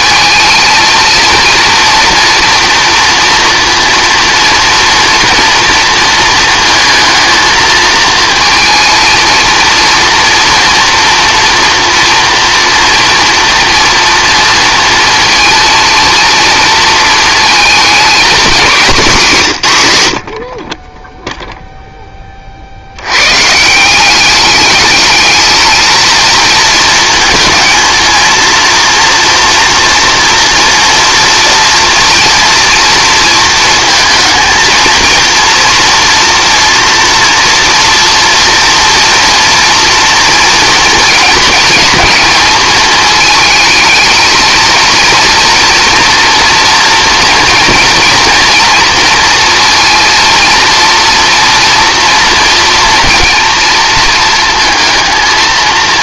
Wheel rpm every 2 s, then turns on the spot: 220, 230, 240, 230, 230, 230, 230, 230, 230, 210, 20, 70, 210, 220, 230, 240, 230, 230, 230, 230, 230, 220, 230, 230, 230, 230, 230, 230.
none